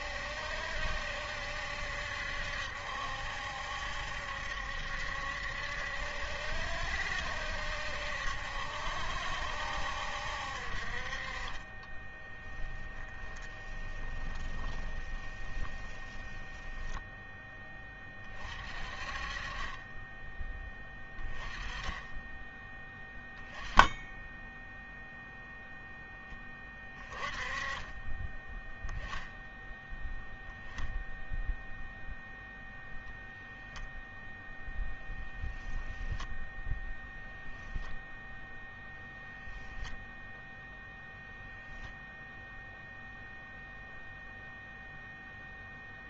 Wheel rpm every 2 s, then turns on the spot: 70, 70, 70, 70, 70, 60, 20, 10, 10, 30, 10, 10, 10, 10, 10, 0, 0, 0, 0, 0, 0, 0, 0.
12-18